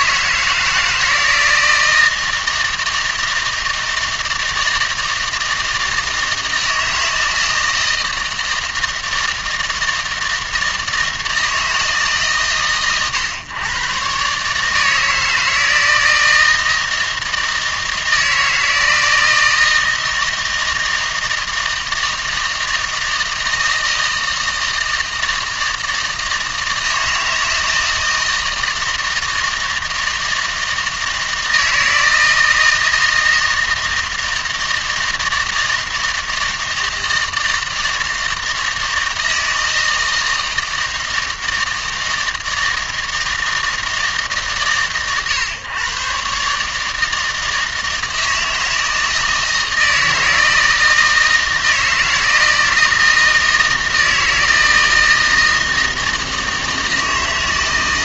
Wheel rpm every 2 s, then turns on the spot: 160, 160, 160, 160, 160, 160, 120, 160, 160, 160, 160, 160, 160, 160, 160, 160, 160, 160, 160, 160, 160, 160, 130, 150, 160, 160, 160, 160, 160.
none